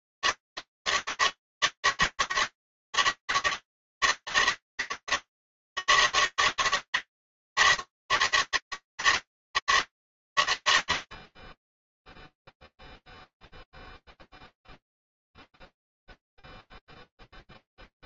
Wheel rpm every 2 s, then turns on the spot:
140, 140, 150, 160, 160, 110, 0, 0, 0.
none